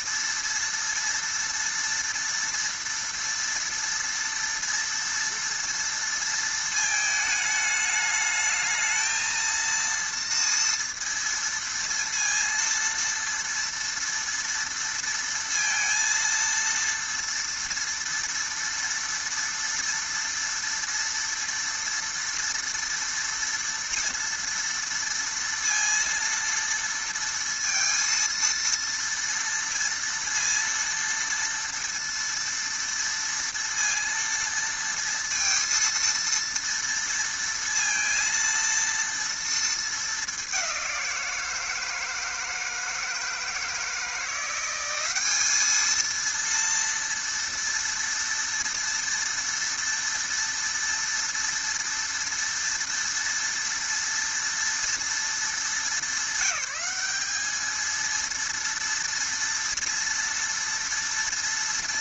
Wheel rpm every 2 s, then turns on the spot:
230, 230, 230, 230, 220, 230, 230, 230, 230, 230, 230, 240, 230, 230, 230, 230, 230, 230, 230, 230, 190, 160, 180, 230, 230, 230, 230, 230, 200, 230, 230.
none